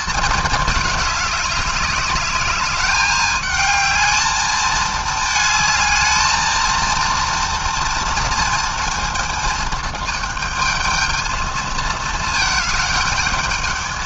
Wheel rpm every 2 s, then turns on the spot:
200, 210, 220, 230, 230, 220, 210.
none